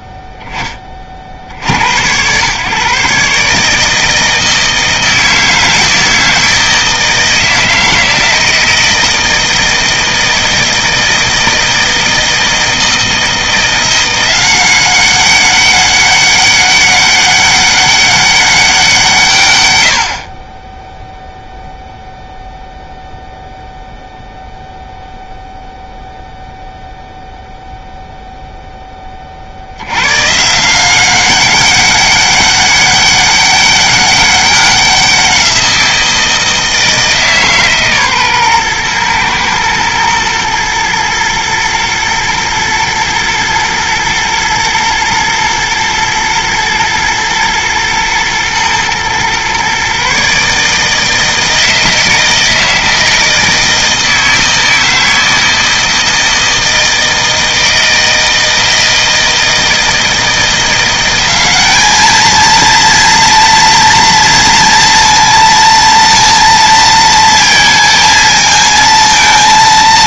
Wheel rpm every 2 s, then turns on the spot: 20, 130, 160, 160, 160, 160, 160, 190, 200, 190, 10, 0, 0, 0, 0, 160, 200, 190, 160, 120, 120, 110, 110, 120, 120, 150, 160, 160, 160, 160, 170, 230, 230, 230, 220.
none